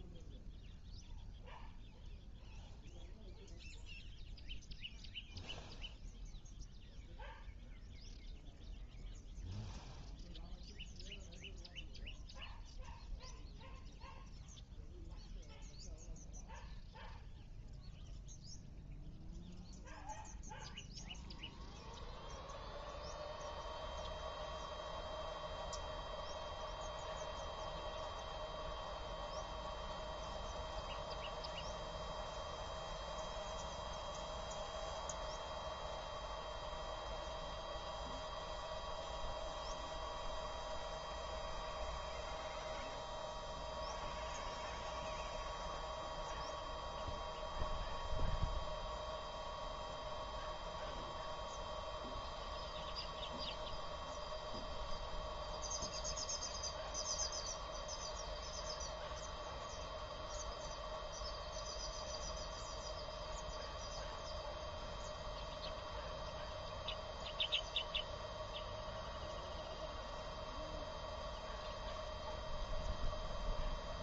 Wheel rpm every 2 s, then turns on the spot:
0, 0, 0, 0, 0, 0, 0, 0, 0, 0, 0, 0, 0, 0, 0, 0, 0, 0, 0, 0, 0, 0, 0, 0, 0, 0, 0, 0, 0, 0, 0, 0, 0, 0, 0, 0, 0.
none